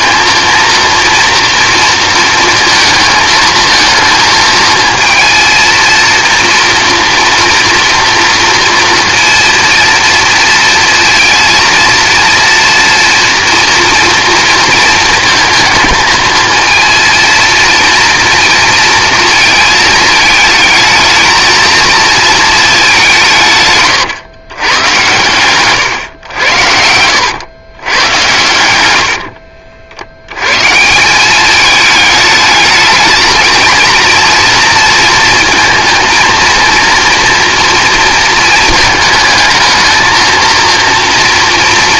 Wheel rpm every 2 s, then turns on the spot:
230, 230, 220, 230, 230, 230, 230, 230, 230, 230, 220, 210, 110, 80, 100, 140, 220, 230, 230, 220, 230.
26-28